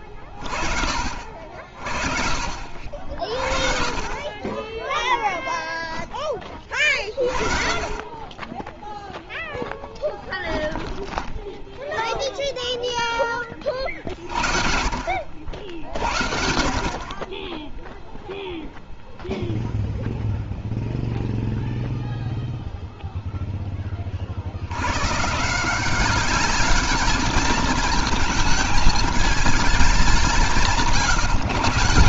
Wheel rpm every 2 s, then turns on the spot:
40, 50, 20, 20, 10, 10, 0, 40, 60, 0, 0, 0, 60, 200, 220, 180.
10-12